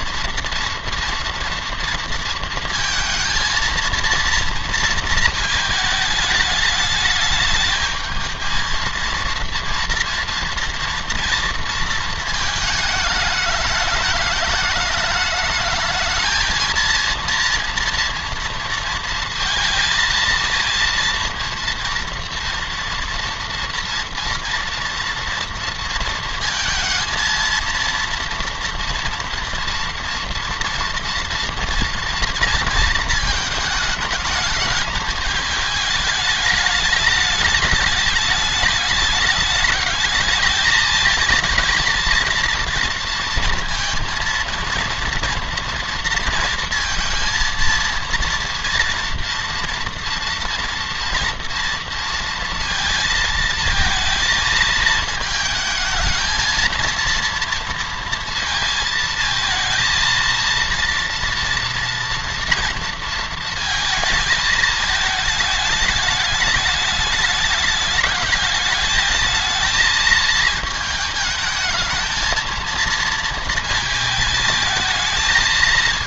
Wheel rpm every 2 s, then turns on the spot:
230, 230, 230, 210, 220, 240, 220, 210, 220, 230, 230, 230, 230, 230, 230, 230, 230, 210, 210, 210, 220, 230, 230, 230, 230, 230, 230, 220, 230, 230, 230, 230, 220, 210, 210, 220, 230, 220.
none